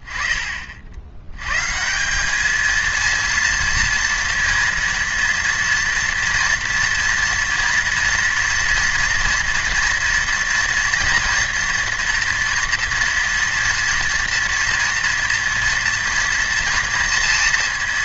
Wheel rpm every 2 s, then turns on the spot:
20, 210, 230, 240, 230, 230, 230, 230, 230.
none